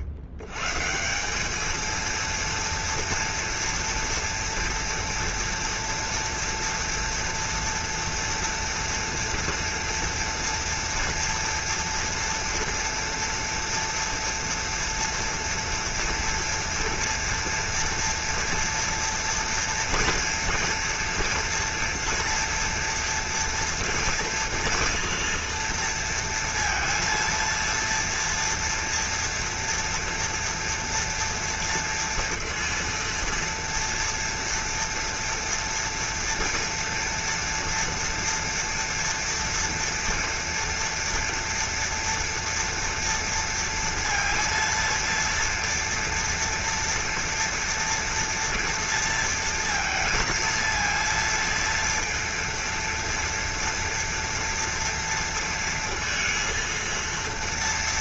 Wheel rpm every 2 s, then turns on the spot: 90, 230, 230, 230, 240, 230, 230, 230, 230, 230, 240, 230, 240, 230, 230, 230, 230, 230, 240, 230, 230, 230, 230, 230, 230, 230, 230, 230, 230.
none